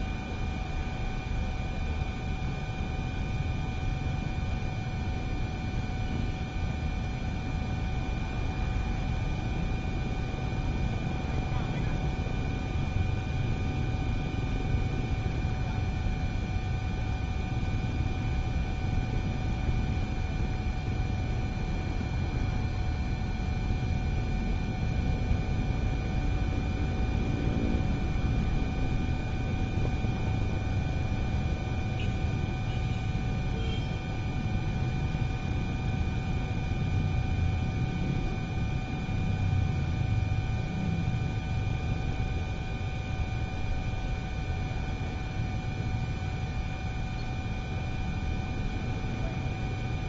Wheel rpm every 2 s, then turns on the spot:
0, 0, 0, 0, 0, 0, 0, 0, 0, 0, 0, 0, 0, 0, 0, 0, 0, 0, 0, 0, 0, 0, 0, 0, 0.
none